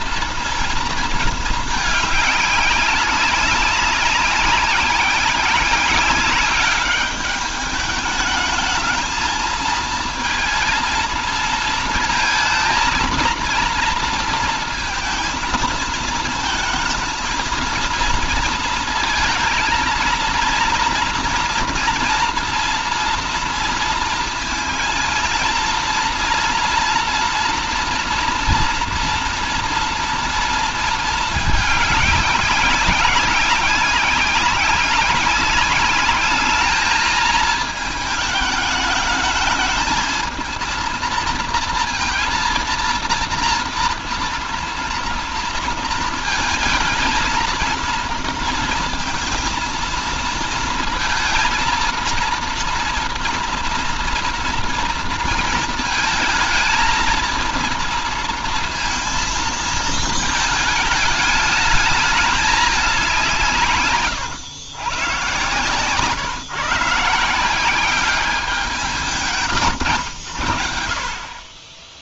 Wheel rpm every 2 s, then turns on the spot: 230, 200, 190, 200, 220, 230, 230, 230, 220, 230, 240, 240, 230, 230, 230, 230, 200, 190, 210, 210, 220, 230, 230, 220, 230, 230, 240, 230, 220, 230, 220, 200, 120, 150, 180, 50.
none